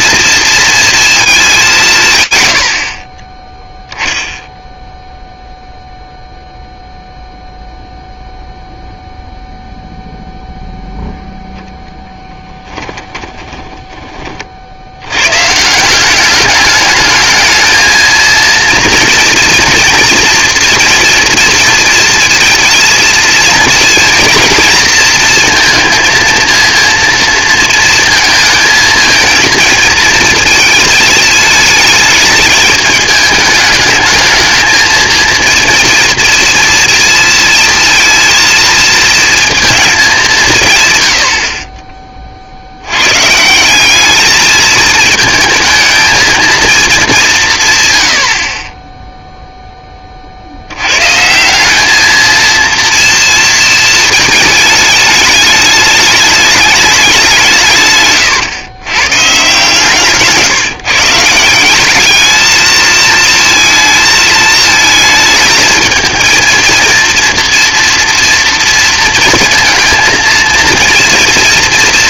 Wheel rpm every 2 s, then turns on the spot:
230, 60, 0, 0, 0, 0, 10, 70, 200, 230, 230, 230, 230, 230, 220, 220, 210, 230, 230, 230, 150, 60, 210, 220, 30, 80, 230, 220, 210, 130, 150, 220, 220, 230, 230, 230.
12-14